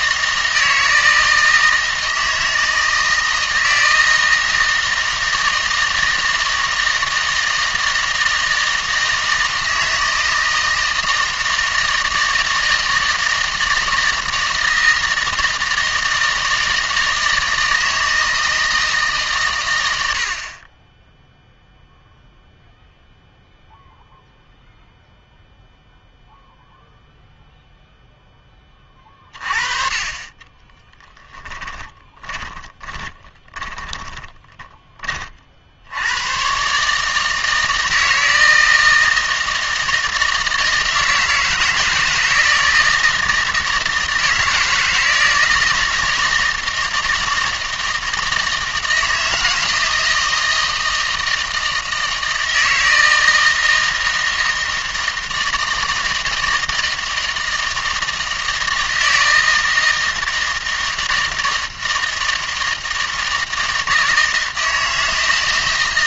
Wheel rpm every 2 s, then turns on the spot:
160, 160, 160, 160, 160, 160, 160, 160, 160, 160, 30, 0, 0, 0, 20, 20, 20, 20, 120, 160, 160, 160, 160, 160, 160, 160, 160, 160, 160, 160, 160, 160, 160.
30-36